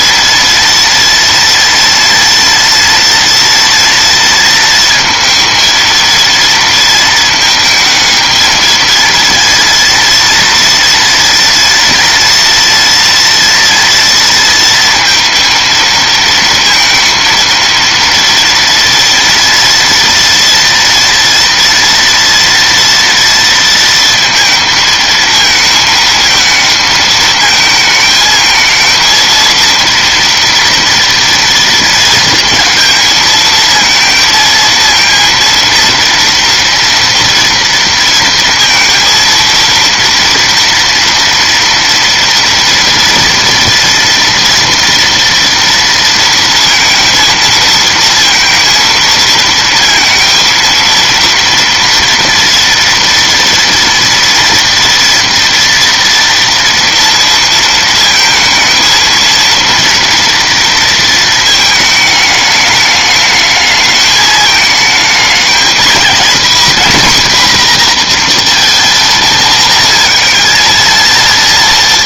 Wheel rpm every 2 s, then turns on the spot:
230, 230, 230, 230, 220, 230, 230, 230, 230, 230, 230, 230, 230, 220, 220, 230, 230, 220, 230, 230, 230, 230, 230, 220, 230, 230, 230, 230, 230, 220, 230, 210, 210, 240, 230, 230.
none